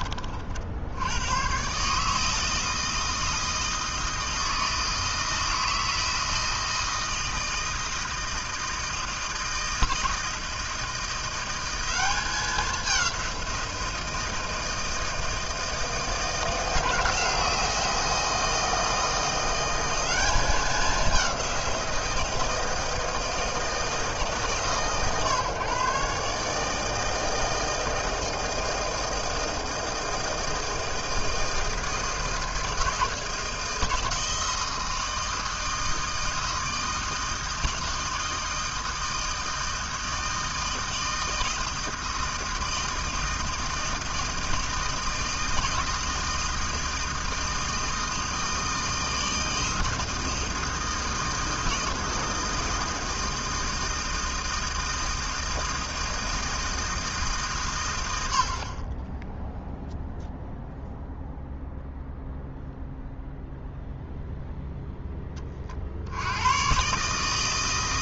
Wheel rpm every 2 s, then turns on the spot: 60, 160, 160, 160, 160, 160, 190, 160, 160, 160, 200, 170, 140, 150, 160, 160, 160, 160, 160, 160, 160, 160, 160, 160, 160, 160, 160, 160, 160, 60, 0, 0, 0, 100.
none